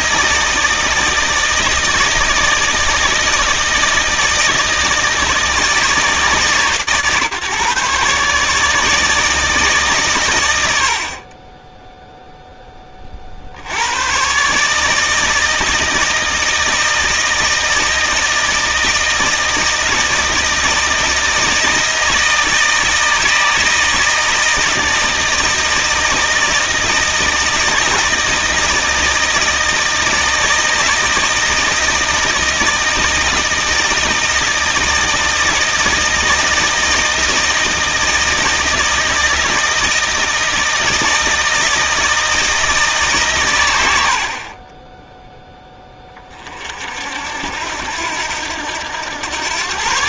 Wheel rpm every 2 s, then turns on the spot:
160, 160, 160, 140, 150, 90, 10, 150, 160, 160, 160, 160, 160, 160, 160, 160, 160, 160, 160, 160, 160, 160, 20, 50, 90.
none